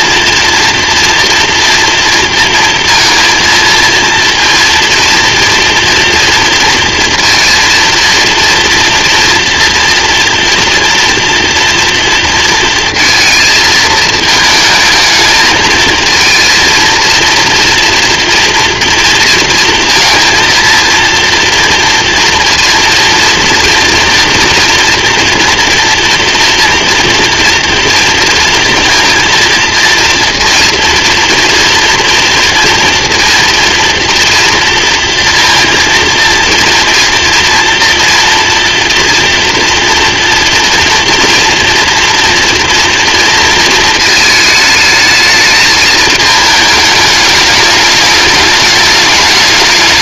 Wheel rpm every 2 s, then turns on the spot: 230, 230, 230, 230, 230, 240, 230, 220, 230, 240, 230, 230, 230, 230, 230, 230, 230, 230, 230, 230, 230, 230, 220, 220, 210.
none